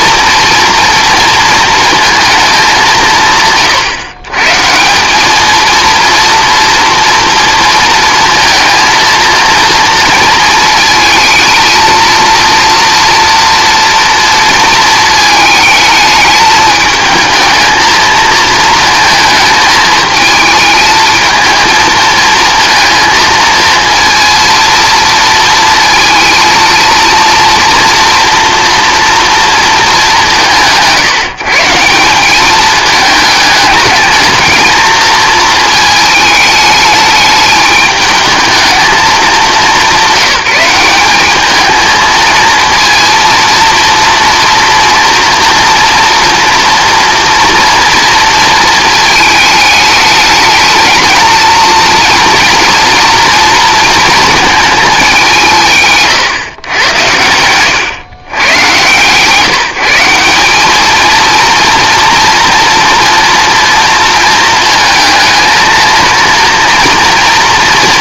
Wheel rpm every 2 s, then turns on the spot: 230, 200, 160, 230, 230, 220, 230, 230, 220, 220, 220, 230, 230, 230, 230, 170, 210, 220, 210, 220, 190, 230, 230, 230, 220, 220, 230, 210, 110, 130, 200, 230, 220, 240.
none